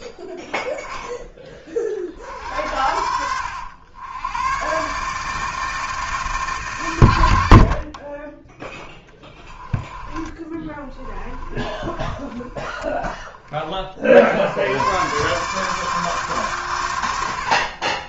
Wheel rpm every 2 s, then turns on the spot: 10, 70, 120, 140, 10, 20, 10, 100, 130.
10-12